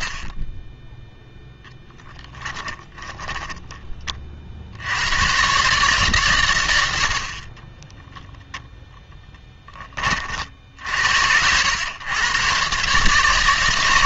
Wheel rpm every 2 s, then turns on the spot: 0, 10, 60, 100, 0, 70, 140.
2-4